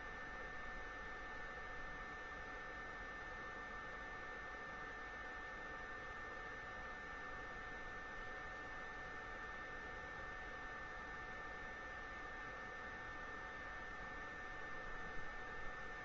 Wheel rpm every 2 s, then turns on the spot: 0, 0, 0, 0, 0, 0, 0, 0.
none